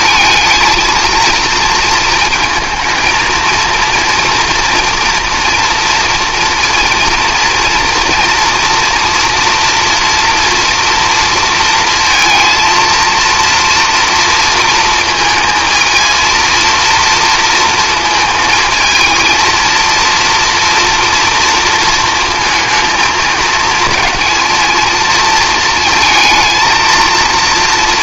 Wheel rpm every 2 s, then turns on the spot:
230, 220, 230, 230, 230, 230, 230, 220, 230, 220, 230, 220, 220, 230.
none